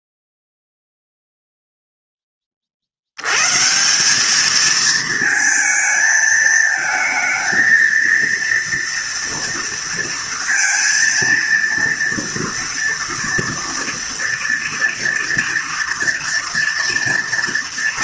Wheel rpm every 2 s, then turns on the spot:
0, 50, 220, 220, 230, 230, 230, 230, 230.
none